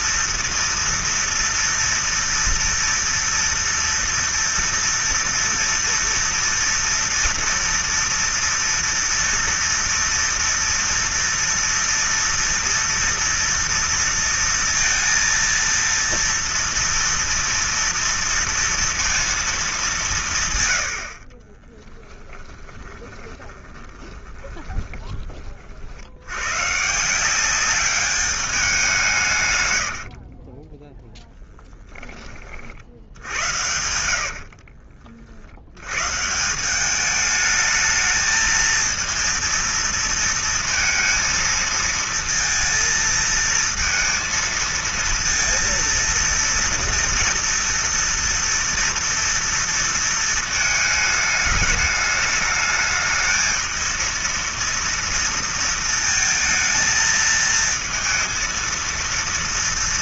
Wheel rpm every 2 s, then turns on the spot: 230, 230, 230, 230, 230, 230, 230, 230, 230, 230, 70, 10, 20, 150, 180, 10, 70, 50, 190, 220, 220, 230, 230, 230, 230, 220, 220, 230, 230, 230.
22-26 34-36